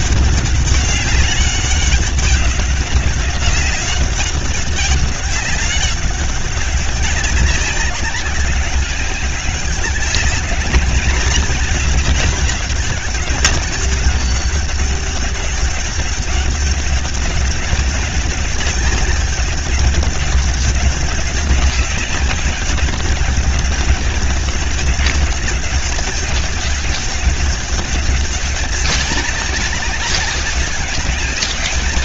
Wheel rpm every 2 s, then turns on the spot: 200, 200, 200, 200, 200, 210, 210, 190, 200, 200, 200, 200, 200, 200, 190, 190.
none